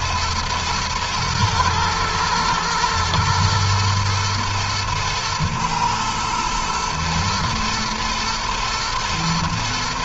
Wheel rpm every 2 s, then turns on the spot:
110, 120, 110, 120, 110.
none